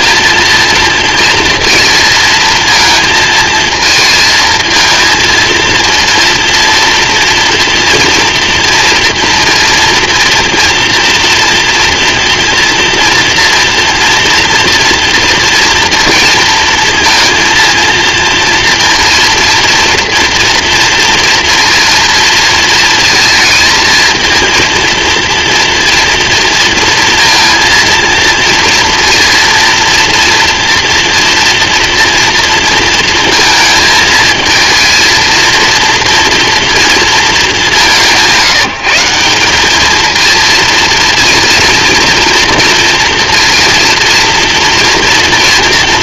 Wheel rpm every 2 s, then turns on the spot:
230, 230, 220, 230, 230, 230, 230, 230, 230, 230, 230, 230, 230, 230, 230, 240, 230, 220, 230, 160, 230, 230, 240.
none